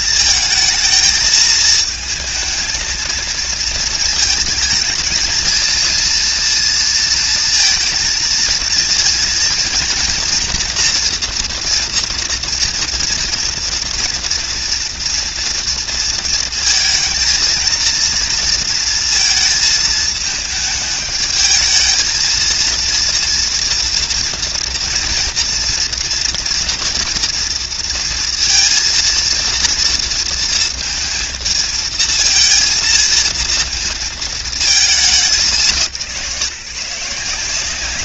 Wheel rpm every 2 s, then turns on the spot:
230, 220, 220, 230, 230, 230, 230, 240, 230, 230, 220, 220, 230, 230, 230, 230, 220, 230, 170.
none